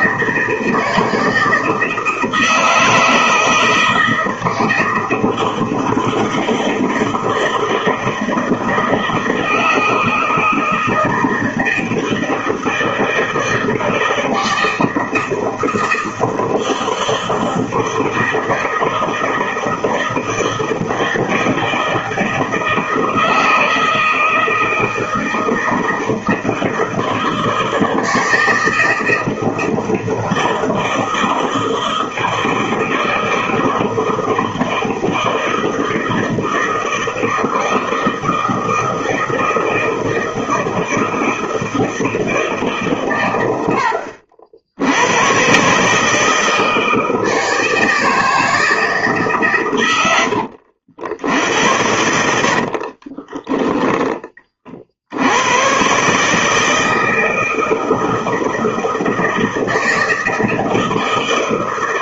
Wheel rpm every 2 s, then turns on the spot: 160, 160, 160, 160, 160, 160, 160, 160, 160, 160, 160, 160, 160, 160, 160, 160, 160, 160, 160, 160, 160, 150, 70, 160, 160, 80, 60, 30, 150, 160, 160.
50-54